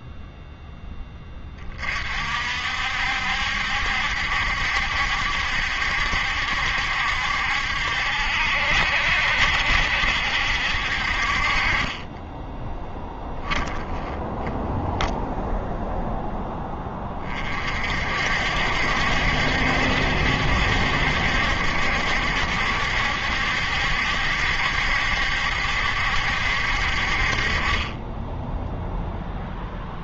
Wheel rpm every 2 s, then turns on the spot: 0, 60, 70, 70, 60, 60, 20, 0, 10, 60, 70, 70, 70, 60, 0.
12-14